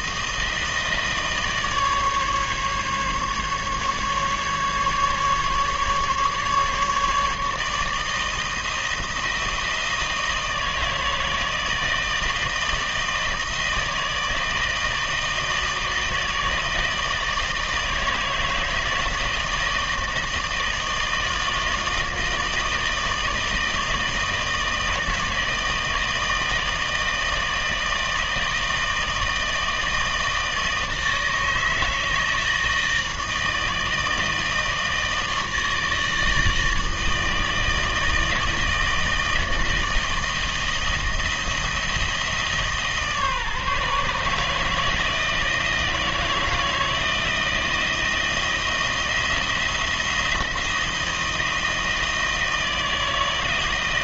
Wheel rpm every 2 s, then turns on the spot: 160, 140, 150, 150, 160, 160, 160, 160, 160, 160, 160, 160, 160, 160, 160, 160, 160, 160, 160, 160, 160, 150, 160, 160, 170, 170, 160.
none